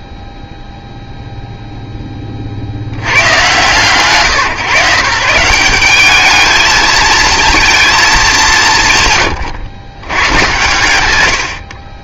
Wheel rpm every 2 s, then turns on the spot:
0, 20, 130, 210, 160, 110.
none